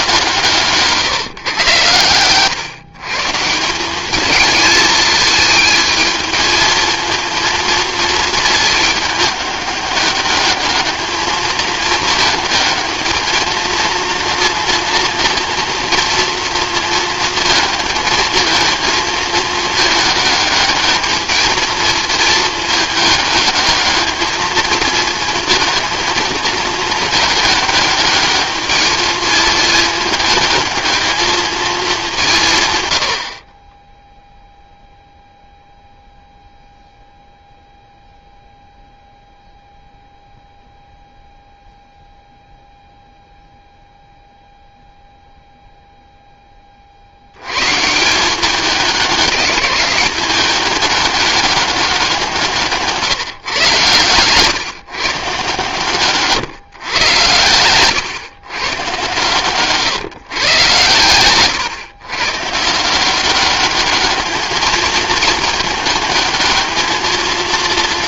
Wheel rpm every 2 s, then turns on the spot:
160, 130, 220, 220, 220, 200, 220, 230, 230, 220, 210, 220, 220, 220, 210, 210, 150, 0, 0, 0, 0, 0, 0, 30, 190, 200, 150, 130, 140, 130, 120, 140, 210, 220.
none